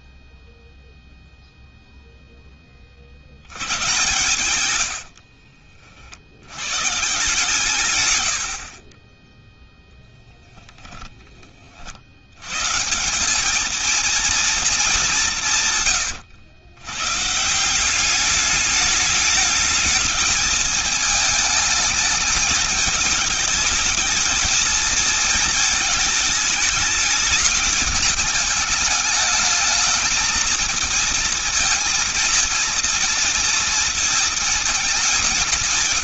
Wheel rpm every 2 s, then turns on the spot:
0, 80, 60, 140, 20, 10, 180, 180, 130, 210, 210, 210, 220, 210, 210, 230, 230, 180.
4-6